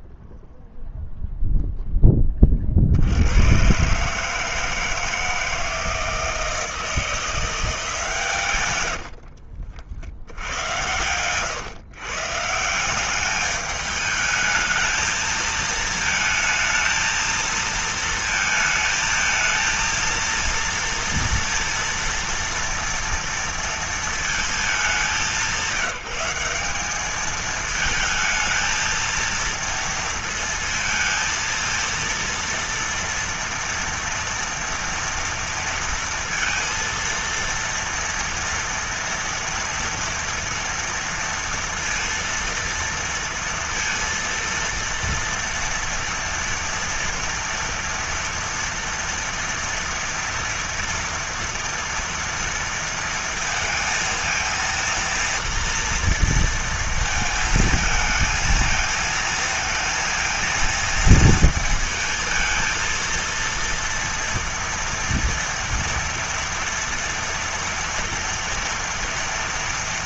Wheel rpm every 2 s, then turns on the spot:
0, 10, 140, 160, 160, 70, 140, 210, 220, 230, 230, 230, 230, 190, 220, 230, 230, 230, 230, 230, 240, 230, 230, 230, 230, 230, 230, 230, 230, 220, 230, 230, 230, 230, 230.
none